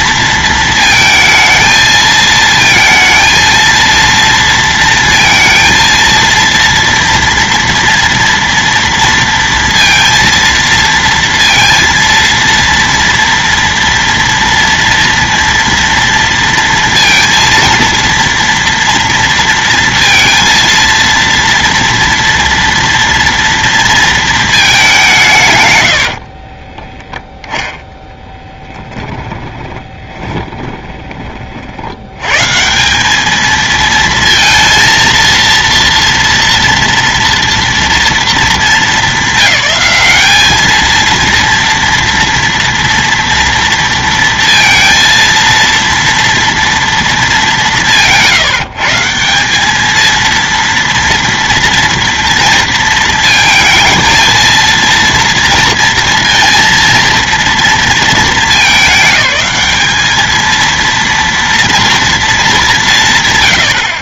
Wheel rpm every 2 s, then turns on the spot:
220, 230, 230, 230, 230, 230, 230, 230, 230, 230, 230, 230, 150, 20, 20, 20, 190, 230, 230, 200, 230, 230, 230, 200, 160, 230, 230, 230, 230, 210, 230, 150.
28-30